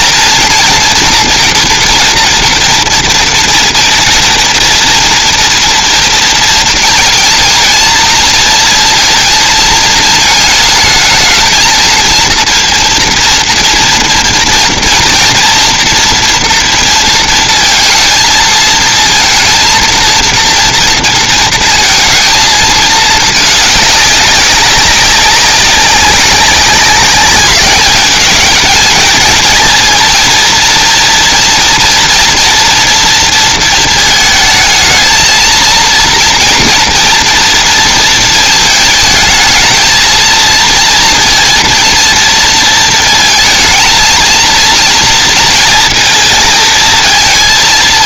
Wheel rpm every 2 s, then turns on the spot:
230, 230, 230, 230, 230, 220, 230, 230, 230, 220, 230, 220, 200, 190, 220, 230, 230, 220, 230, 220, 230, 230, 230, 230.
none